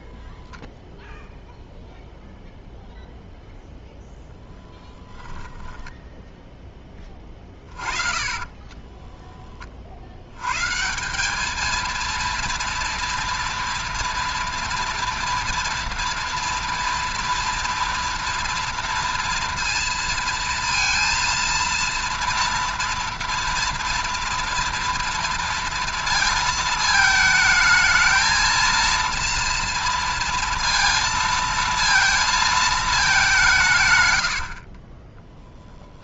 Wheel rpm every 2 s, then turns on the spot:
0, 0, 10, 30, 40, 230, 230, 230, 230, 230, 230, 230, 230, 220, 230, 220, 150, 10.
4-8